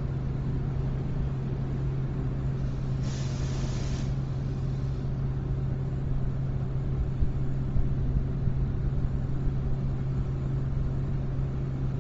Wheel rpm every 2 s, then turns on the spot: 0, 0, 0, 0, 0, 0.
none